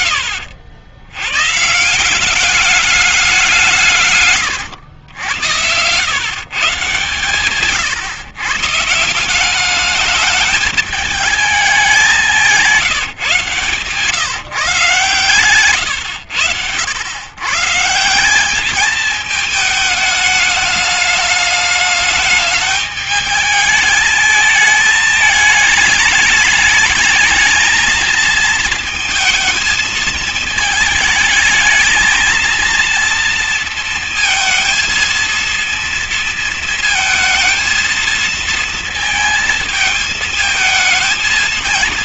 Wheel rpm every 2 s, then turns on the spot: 70, 200, 120, 130, 130, 210, 190, 130, 100, 200, 210, 210, 220, 220, 230, 220, 230, 230, 230, 220, 220.
none